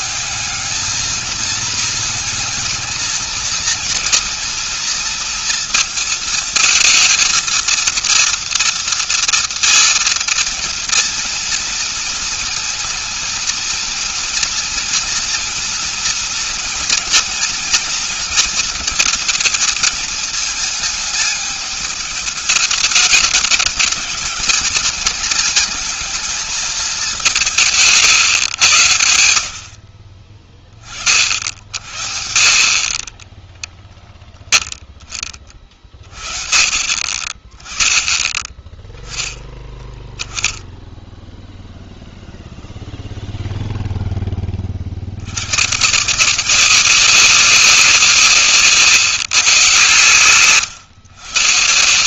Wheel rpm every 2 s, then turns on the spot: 200, 230, 230, 220, 230, 230, 230, 230, 230, 230, 220, 210, 220, 220, 130, 30, 60, 0, 40, 20, 10, 0, 20, 160, 160, 120.
none